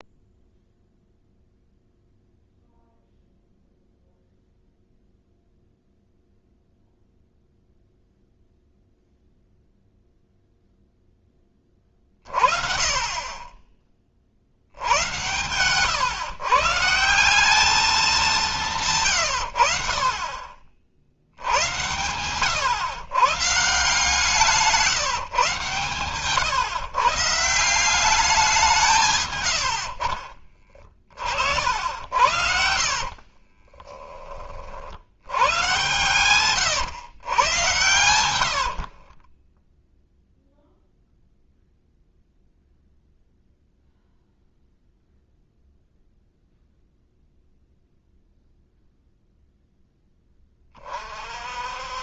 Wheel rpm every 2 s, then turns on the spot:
0, 0, 0, 0, 0, 0, 30, 70, 130, 180, 40, 120, 170, 130, 180, 30, 70, 40, 110, 70, 0, 0, 0, 0, 0, 20.
30-34 38-40